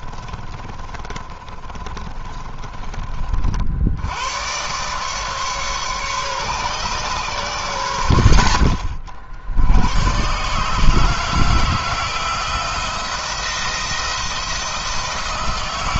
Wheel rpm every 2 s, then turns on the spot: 20, 30, 130, 130, 40, 140, 170, 160.
0-2